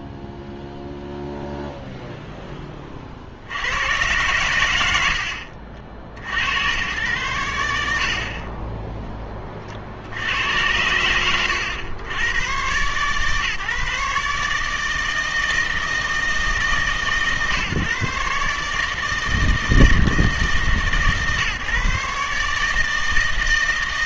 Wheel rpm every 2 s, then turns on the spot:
0, 20, 90, 90, 20, 90, 130, 160, 150, 150, 150, 150.
none